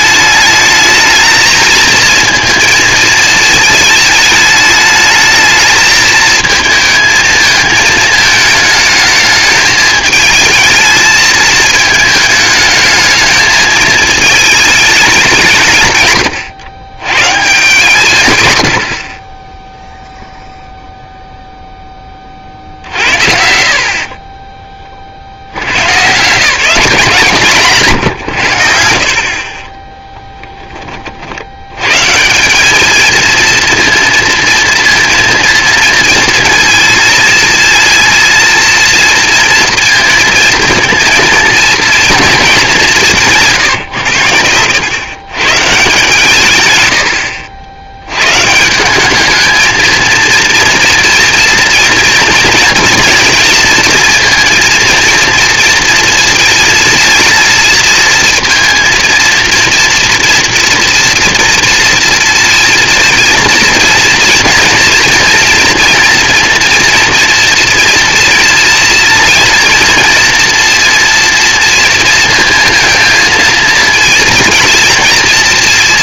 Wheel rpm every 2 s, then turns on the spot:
210, 230, 220, 220, 220, 220, 220, 220, 110, 100, 0, 60, 20, 160, 80, 20, 190, 230, 230, 230, 230, 200, 100, 130, 160, 230, 230, 230, 230, 230, 230, 230, 230, 240, 230, 230, 230, 220.
none